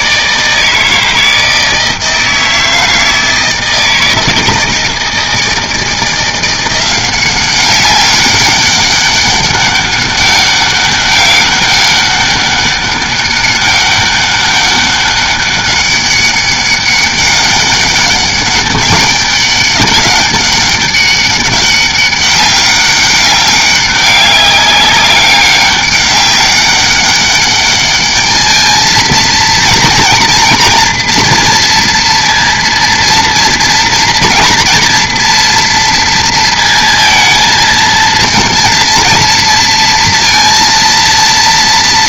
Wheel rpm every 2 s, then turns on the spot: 160, 160, 160, 180, 200, 200, 200, 200, 200, 200, 200, 200, 190, 200, 220, 230, 230, 230, 230, 230, 230.
none